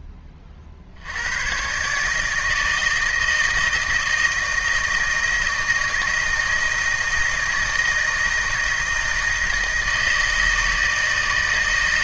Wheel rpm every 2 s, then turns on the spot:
40, 160, 160, 160, 160, 160.
none